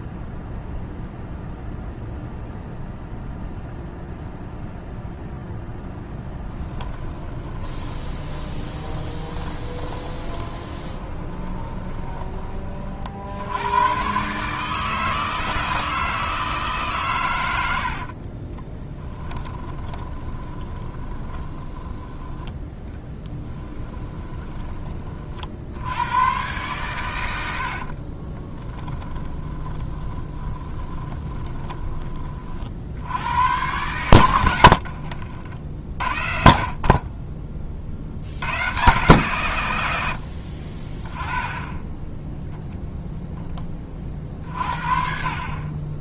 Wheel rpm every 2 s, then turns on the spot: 0, 0, 0, 20, 20, 20, 40, 150, 140, 20, 30, 10, 30, 120, 10, 20, 60, 60, 50, 130, 30, 0, 40.
6-12 18-24 28-32 34-36